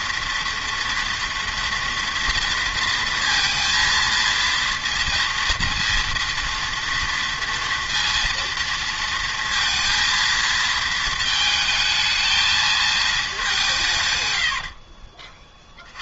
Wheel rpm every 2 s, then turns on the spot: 230, 230, 230, 230, 230, 220, 220, 50.
14-16